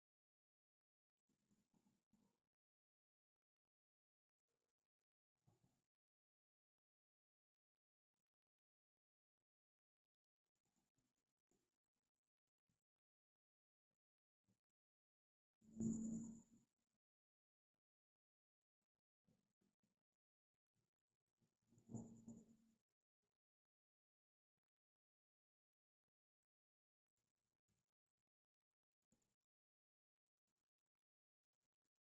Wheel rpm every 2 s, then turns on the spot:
0, 0, 0, 0, 0, 0, 0, 0, 0, 0, 0, 0, 0, 0, 0, 0.
none